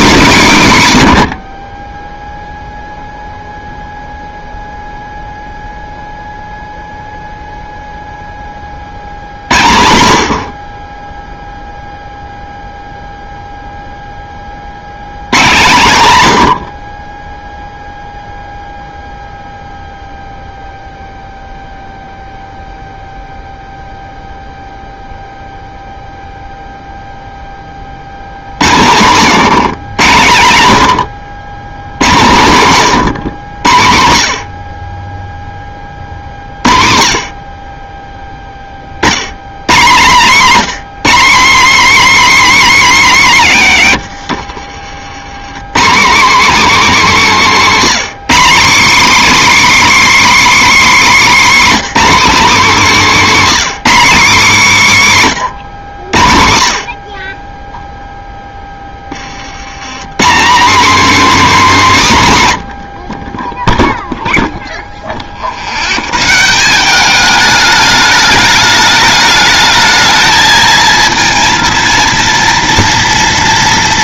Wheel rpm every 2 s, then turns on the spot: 180, 0, 0, 0, 30, 40, 0, 60, 90, 0, 0, 0, 0, 0, 100, 110, 140, 40, 60, 10, 220, 300, 70, 280, 270, 320, 270, 220, 70, 10, 230, 130, 0, 180, 210, 220, 230.
44-46